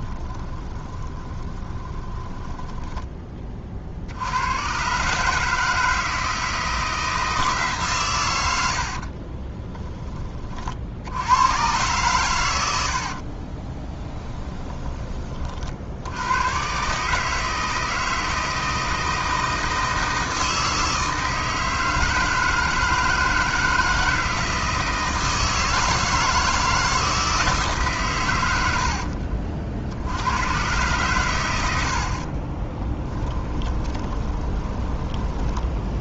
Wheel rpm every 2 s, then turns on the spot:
20, 10, 120, 160, 70, 60, 80, 20, 140, 160, 160, 160, 160, 160, 70, 120, 20, 20.
0-4 12-14 32-34